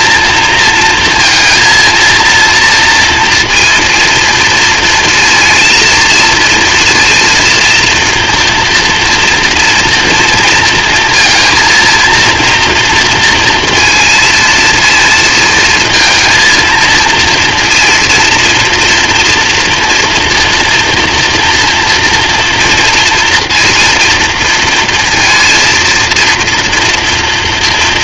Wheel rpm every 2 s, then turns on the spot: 230, 240, 230, 230, 230, 230, 230, 230, 230, 240, 230, 230, 230, 240.
none